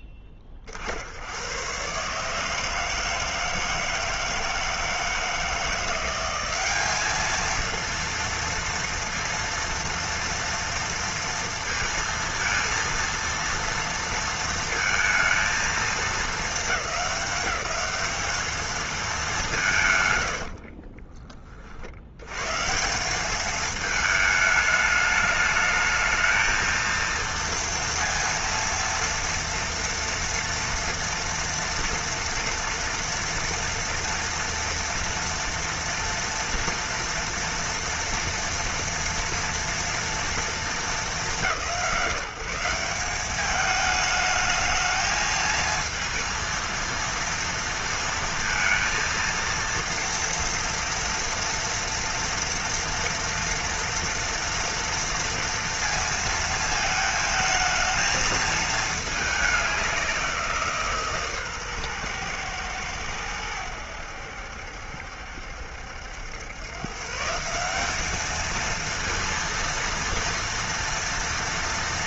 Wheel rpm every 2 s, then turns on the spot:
50, 160, 160, 200, 230, 230, 230, 230, 210, 220, 50, 150, 210, 220, 230, 230, 230, 230, 240, 240, 210, 180, 220, 230, 230, 230, 230, 230, 220, 220, 160, 110, 70, 130, 230, 230.
20-22